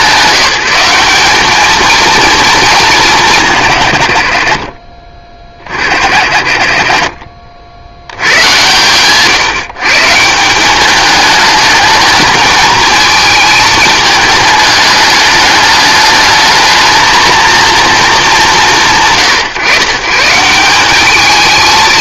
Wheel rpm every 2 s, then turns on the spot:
180, 210, 30, 40, 130, 200, 220, 210, 220, 140, 200.
none